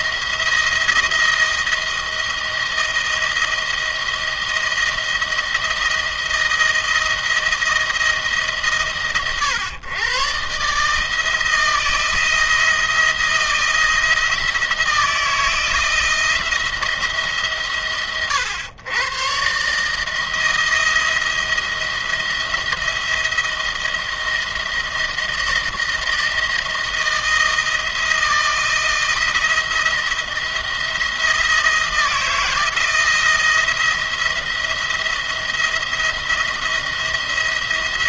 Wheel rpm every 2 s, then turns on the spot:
170, 160, 160, 160, 130, 150, 170, 160, 150, 120, 170, 170, 160, 160, 160, 170, 160, 170, 170.
none